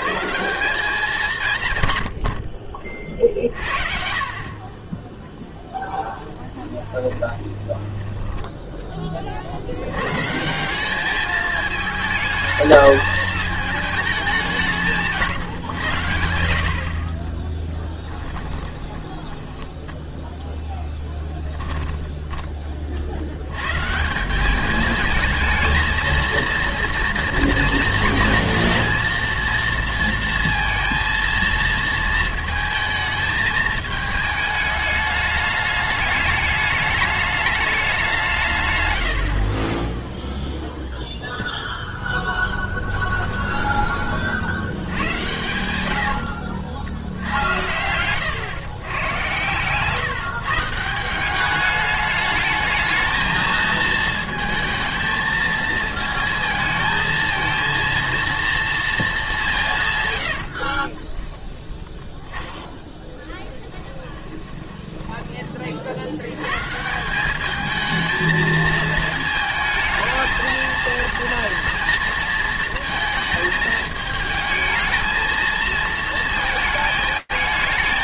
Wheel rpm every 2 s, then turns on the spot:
180, 50, 40, 20, 10, 180, 220, 190, 60, 10, 10, 20, 200, 230, 230, 230, 220, 210, 210, 130, 0, 20, 70, 70, 120, 160, 220, 220, 230, 230, 60, 10, 10, 130, 220, 220, 220, 220, 220.
6-8 18-22 42-44 60-62 64-66